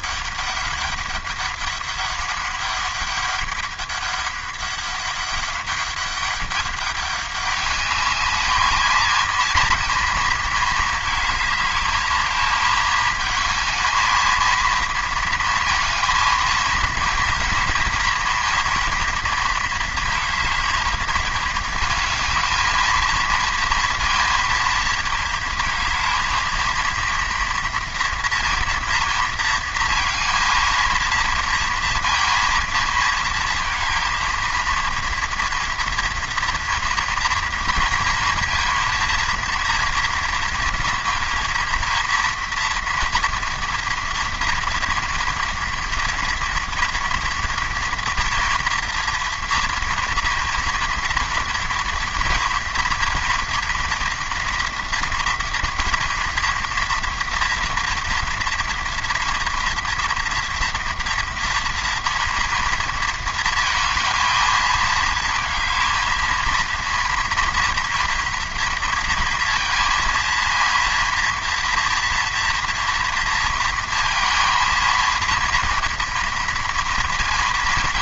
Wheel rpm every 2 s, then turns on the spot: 200, 200, 200, 200, 220, 220, 220, 230, 220, 230, 220, 220, 230, 230, 230, 230, 230, 230, 230, 230, 230, 230, 230, 230, 230, 230, 240, 230, 230, 230, 230, 230, 220, 230, 230, 230, 230, 230, 230.
none